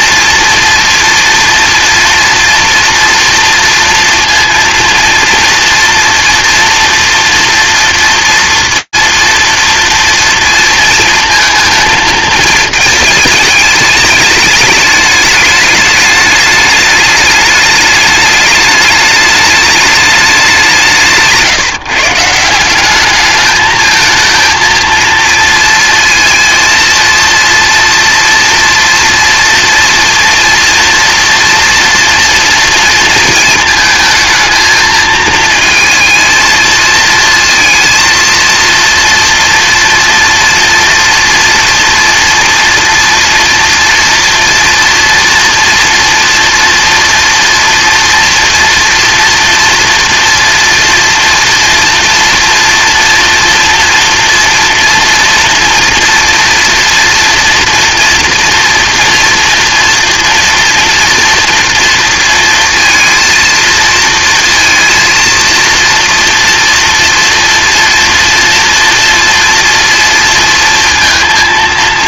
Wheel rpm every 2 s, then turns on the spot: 230, 230, 230, 240, 230, 230, 220, 210, 210, 210, 170, 200, 230, 230, 230, 240, 230, 220, 220, 230, 230, 240, 230, 240, 230, 230, 240, 230, 230, 230, 230, 230, 230, 240, 230, 230.
none